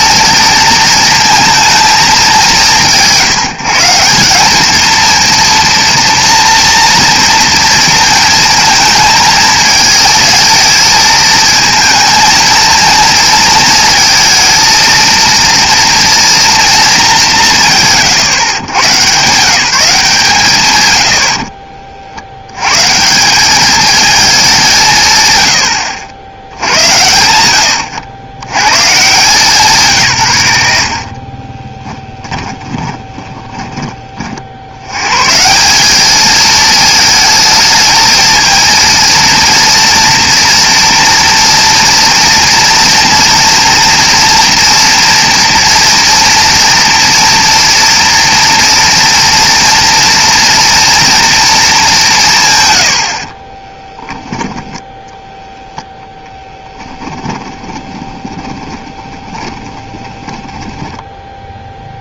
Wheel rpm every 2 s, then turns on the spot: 230, 180, 220, 230, 220, 220, 230, 220, 220, 120, 120, 130, 180, 110, 120, 80, 20, 90, 220, 230, 230, 230, 230, 230, 230, 230, 120, 10, 10, 20, 10.
32-34 56-62